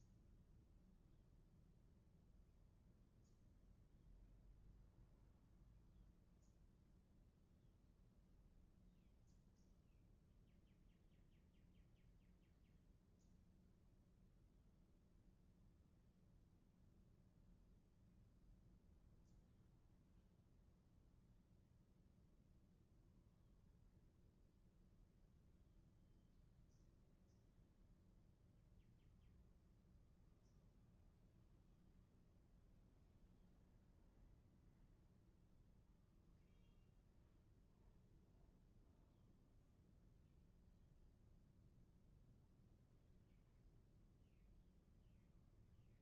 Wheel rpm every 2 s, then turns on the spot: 0, 0, 0, 0, 0, 0, 0, 0, 0, 0, 0, 0, 0, 0, 0, 0, 0, 0, 0, 0, 0, 0, 0.
none